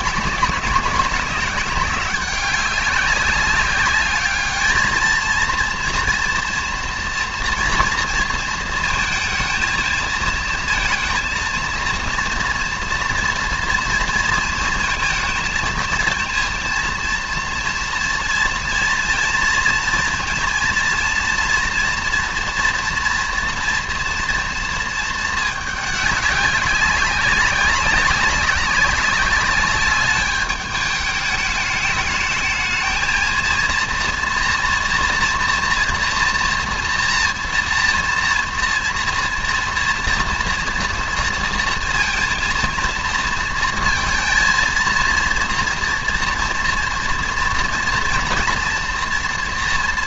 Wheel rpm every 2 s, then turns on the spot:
200, 200, 220, 240, 230, 230, 230, 230, 230, 230, 230, 230, 230, 200, 200, 210, 220, 230, 230, 230, 230, 230, 230, 230, 230.
none